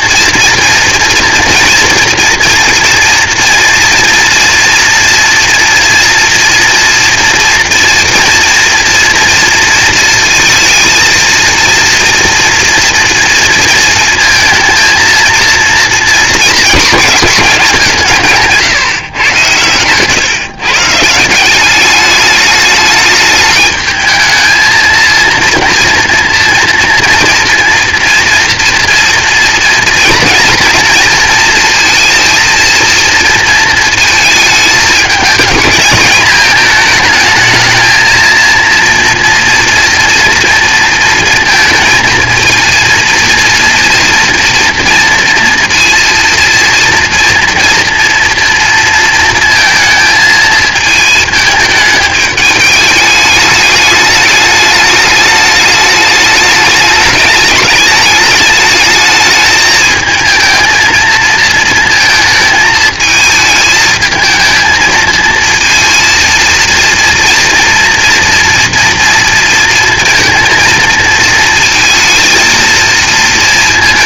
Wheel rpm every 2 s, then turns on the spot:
230, 240, 240, 230, 230, 220, 230, 230, 220, 140, 140, 210, 220, 230, 240, 230, 230, 220, 220, 230, 230, 230, 230, 230, 230, 220, 210, 210, 210, 210, 230, 220, 220, 230, 240, 230, 230.
18-20